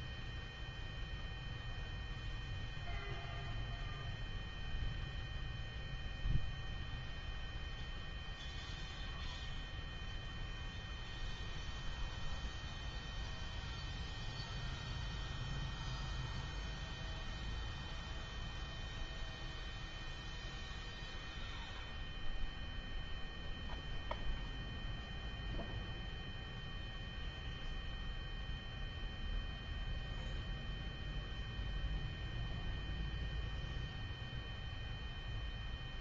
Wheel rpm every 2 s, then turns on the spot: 0, 0, 0, 0, 0, 0, 0, 0, 0, 0, 0, 0, 0, 0, 0, 0, 0, 0.
none